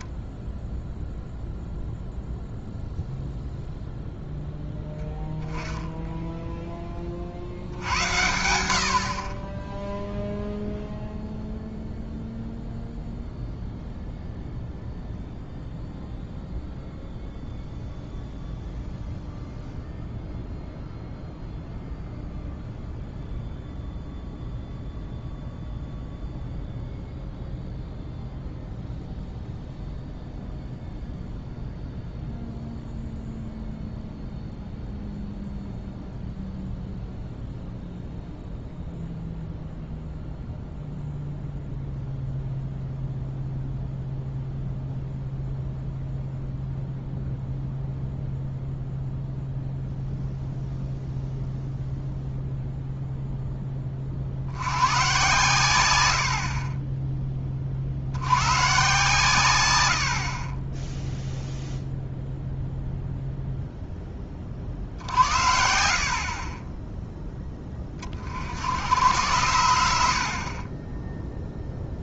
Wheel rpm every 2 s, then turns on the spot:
0, 0, 0, 10, 80, 0, 0, 0, 0, 0, 0, 0, 0, 0, 0, 0, 0, 0, 0, 0, 0, 0, 0, 0, 0, 0, 0, 110, 30, 130, 20, 0, 50, 20, 80, 20.
none